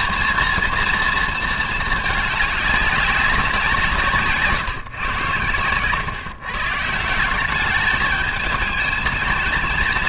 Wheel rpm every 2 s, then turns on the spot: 230, 210, 150, 140, 210.
none